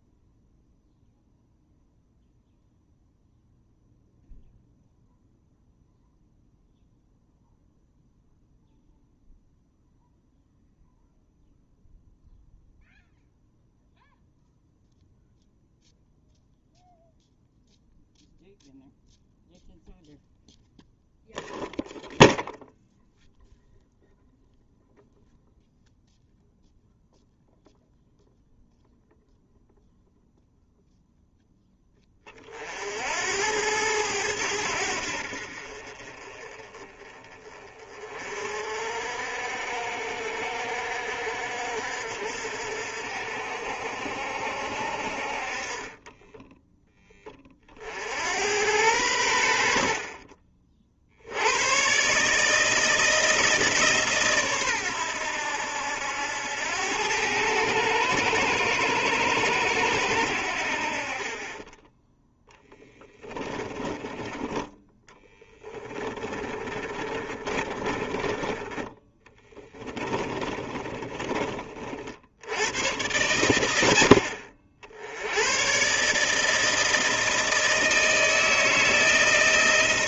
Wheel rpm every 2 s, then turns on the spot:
0, 0, 0, 0, 0, 0, 0, 0, 0, 0, 0, 0, 0, 0, 0, 0, 50, 80, 30, 50, 60, 60, 60, 10, 90, 40, 160, 110, 90, 110, 60, 10, 10, 20, 20, 30, 100, 70, 160, 160.
62-64 66-68 70-72